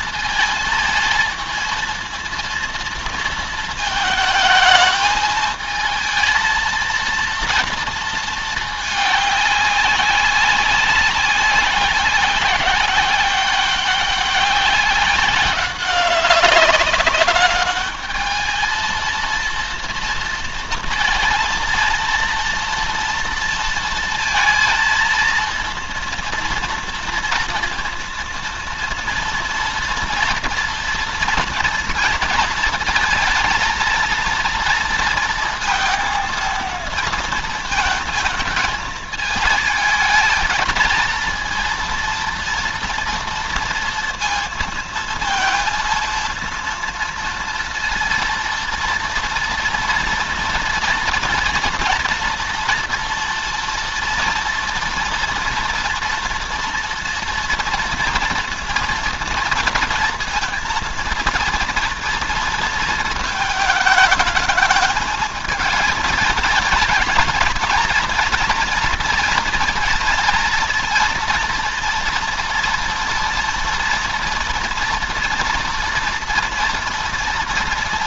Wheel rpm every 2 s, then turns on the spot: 220, 230, 220, 230, 220, 190, 200, 200, 190, 220, 230, 230, 230, 230, 230, 230, 230, 230, 230, 220, 220, 230, 230, 230, 230, 230, 230, 230, 230, 230, 230, 230, 220, 210, 230, 220, 230, 240, 230.
none